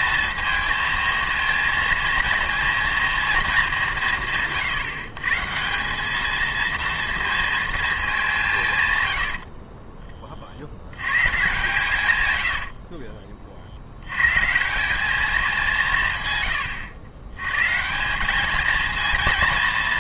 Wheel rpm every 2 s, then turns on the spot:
220, 230, 150, 230, 140, 70, 60, 170, 110, 220.
8-10 12-14